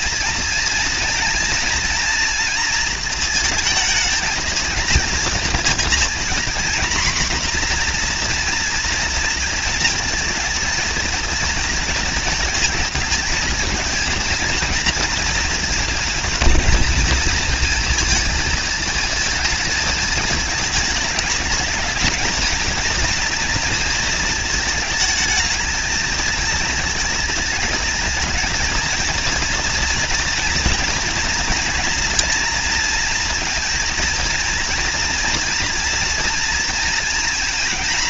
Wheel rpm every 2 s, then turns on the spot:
230, 230, 230, 240, 240, 220, 230, 230, 230, 220, 220, 220, 220, 220, 230, 230, 230, 230, 230.
none